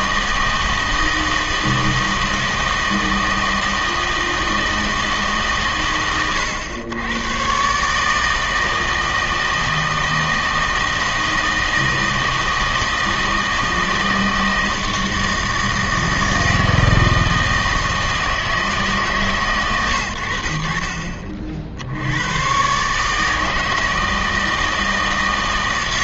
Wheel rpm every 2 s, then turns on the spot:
160, 160, 160, 110, 160, 160, 160, 160, 160, 160, 70, 130, 160.
none